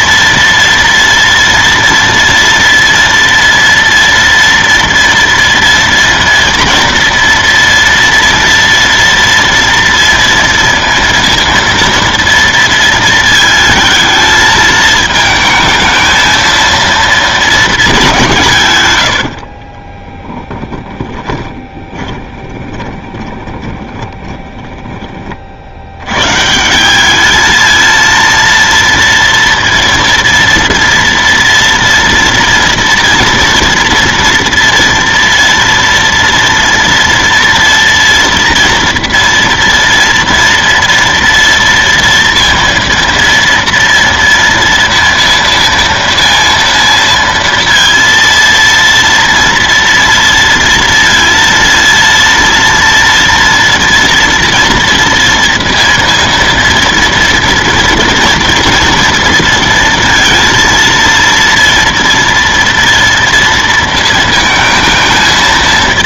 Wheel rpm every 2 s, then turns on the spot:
230, 230, 230, 230, 230, 230, 230, 220, 230, 150, 10, 20, 10, 160, 230, 230, 230, 230, 230, 230, 230, 230, 230, 230, 230, 230, 230, 230, 230, 230, 230, 230, 230.
20-26